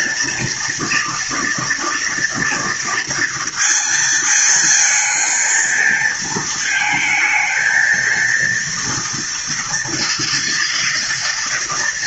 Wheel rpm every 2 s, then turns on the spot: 230, 240, 230, 230, 230, 230.
none